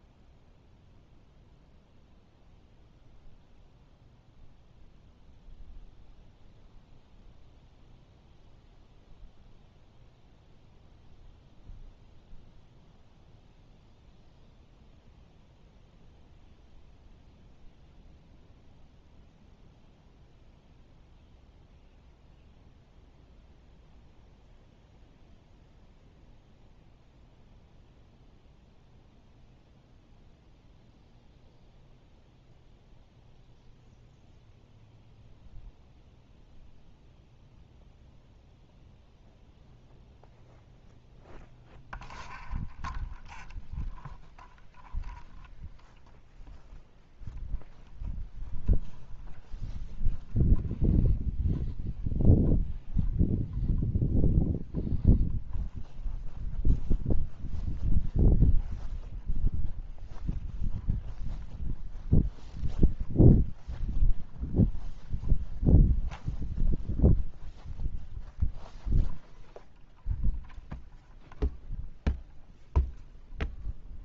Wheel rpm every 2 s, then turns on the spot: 0, 0, 0, 0, 0, 0, 0, 0, 0, 0, 0, 0, 0, 0, 0, 0, 0, 0, 0, 0, 0, 0, 0, 0, 0, 0, 0, 0, 0, 0, 0, 0, 0, 0, 0, 0, 0.
none